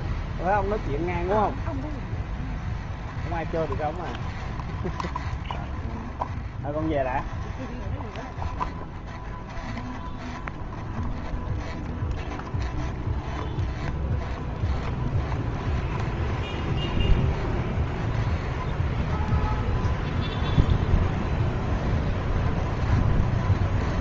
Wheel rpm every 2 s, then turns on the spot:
0, 0, 0, 0, 0, 0, 0, 0, 0, 0, 0, 0.
none